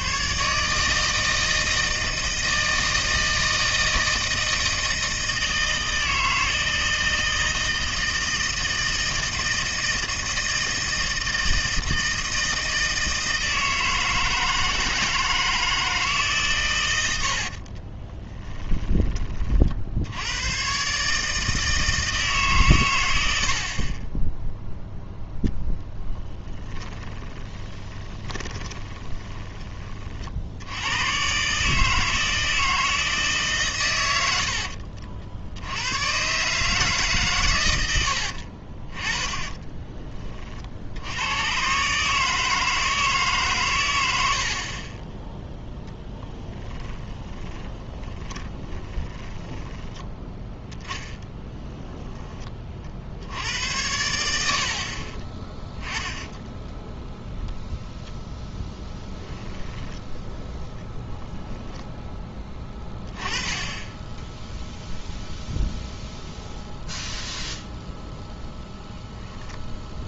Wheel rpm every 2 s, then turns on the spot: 150, 160, 160, 160, 160, 160, 160, 160, 120, 10, 130, 130, 0, 10, 20, 90, 160, 60, 140, 40, 60, 160, 40, 20, 20, 10, 40, 70, 10, 10, 0, 10, 0, 0, 10.
26-30 34-36 38-40 46-50 56-58